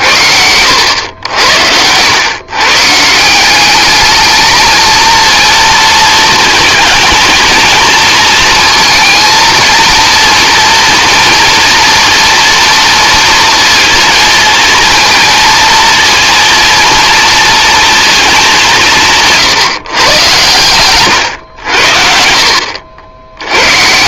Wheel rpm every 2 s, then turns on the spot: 80, 130, 220, 230, 220, 230, 230, 230, 230, 180, 120, 70.
none